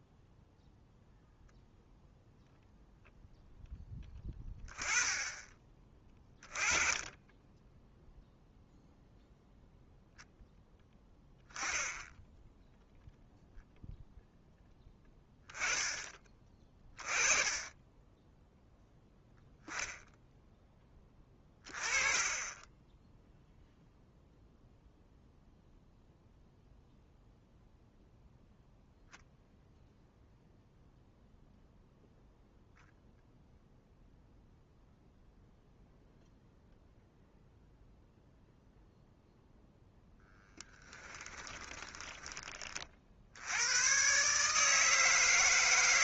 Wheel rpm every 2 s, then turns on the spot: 0, 0, 10, 20, 0, 10, 0, 0, 20, 0, 10, 20, 0, 0, 0, 0, 0, 0, 0, 0, 10, 30, 150.
22-24 40-42